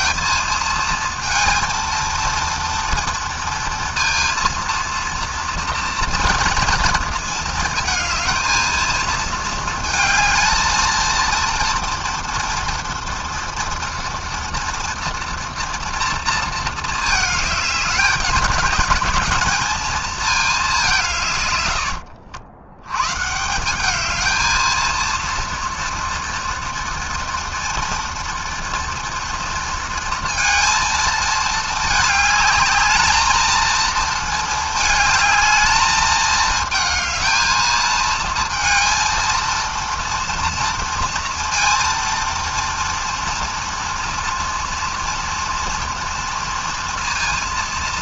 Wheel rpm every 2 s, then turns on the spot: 230, 230, 230, 230, 230, 230, 230, 230, 220, 220, 140, 140, 230, 230, 230, 220, 220, 220, 220, 230, 230, 230, 230, 230.
none